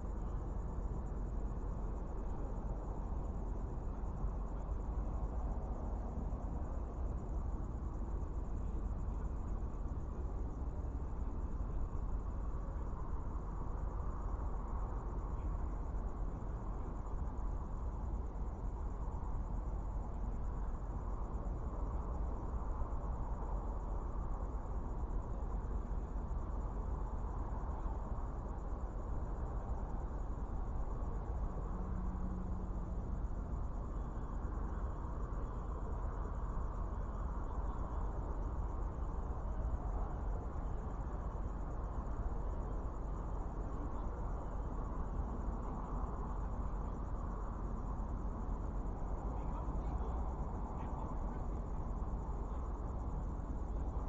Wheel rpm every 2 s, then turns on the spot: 0, 0, 0, 0, 0, 0, 0, 0, 0, 0, 0, 0, 0, 0, 0, 0, 0, 0, 0, 0, 0, 0, 0, 0, 0, 0, 0.
none